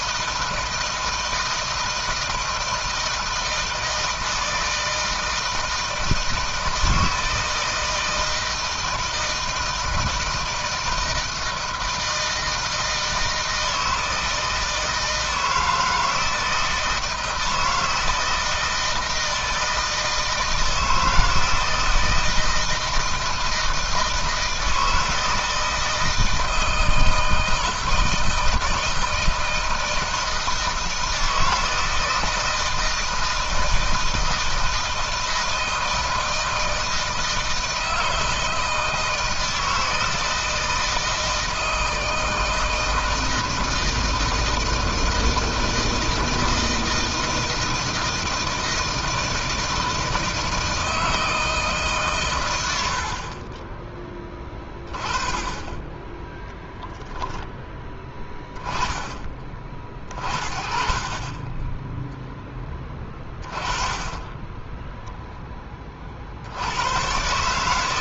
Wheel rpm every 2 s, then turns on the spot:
160, 160, 160, 160, 160, 170, 160, 160, 160, 160, 160, 170, 160, 160, 160, 160, 160, 160, 160, 160, 160, 160, 160, 160, 160, 160, 120, 20, 0, 10, 40, 10, 10, 70.
64-66